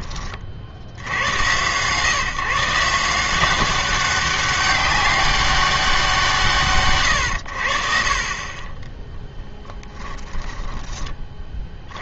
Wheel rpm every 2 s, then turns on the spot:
40, 150, 190, 160, 30, 10.
10-12